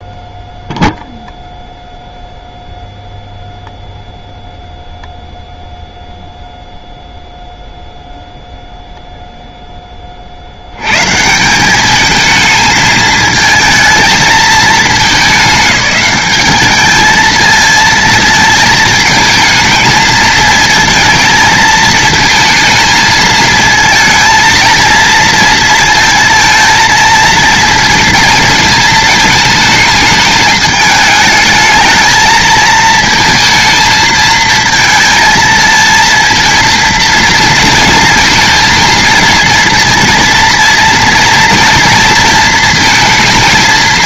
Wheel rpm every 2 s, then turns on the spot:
0, 0, 0, 0, 0, 80, 220, 210, 210, 220, 220, 220, 230, 230, 220, 210, 220, 230, 230, 230, 230, 230.
none